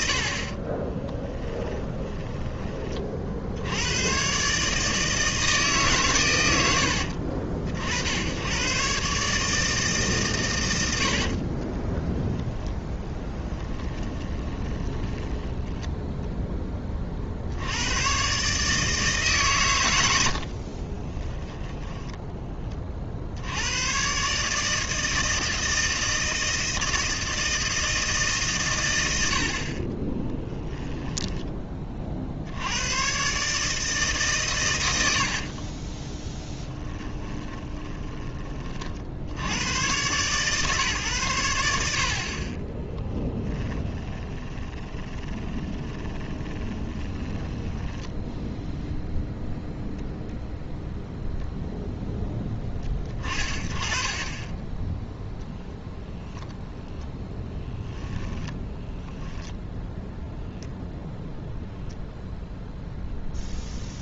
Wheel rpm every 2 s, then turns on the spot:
40, 20, 150, 100, 110, 110, 10, 10, 10, 140, 60, 20, 150, 160, 130, 10, 80, 120, 10, 30, 140, 20, 20, 20, 0, 0, 20, 20, 0, 10, 0, 0.
0-2 14-16 20-22 30-32 36-38 44-48 58-60